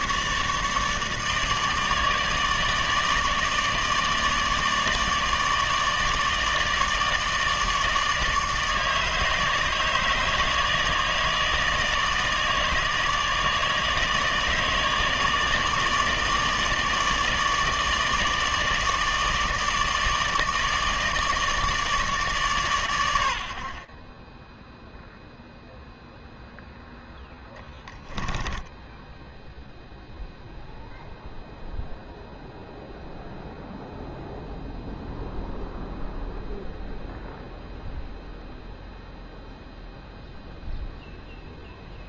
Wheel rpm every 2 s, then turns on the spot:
150, 150, 160, 150, 150, 160, 160, 150, 160, 150, 160, 90, 0, 0, 0, 0, 0, 0, 0, 0, 0.
none